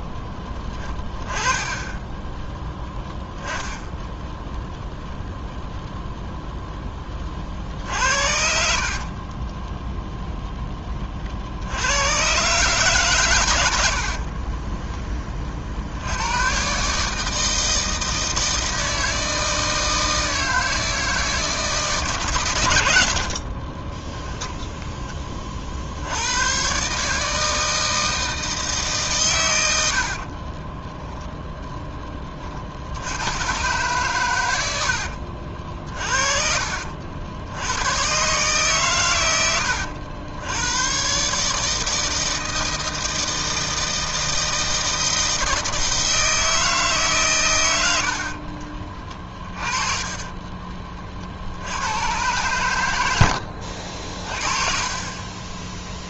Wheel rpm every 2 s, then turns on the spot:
10, 10, 0, 10, 60, 10, 140, 30, 130, 160, 160, 100, 10, 120, 160, 30, 50, 90, 50, 130, 100, 160, 160, 160, 40, 30, 110, 30.
0-2 8-10 14-16 30-32 48-52